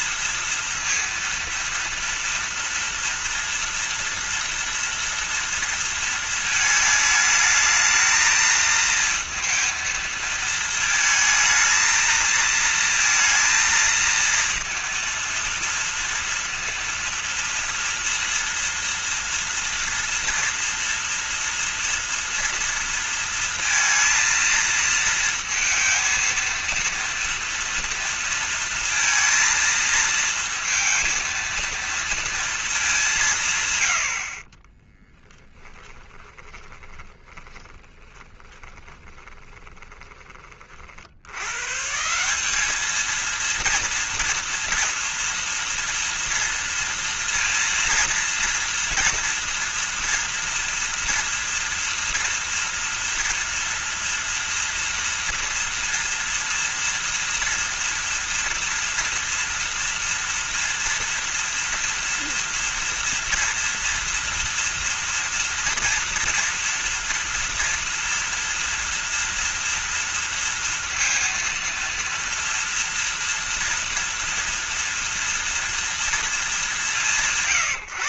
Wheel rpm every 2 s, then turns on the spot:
230, 230, 230, 220, 220, 220, 230, 230, 230, 230, 230, 230, 230, 230, 230, 230, 230, 40, 10, 20, 30, 190, 230, 230, 230, 230, 230, 230, 230, 230, 230, 230, 230, 230, 230, 230, 230, 230, 180.
34-40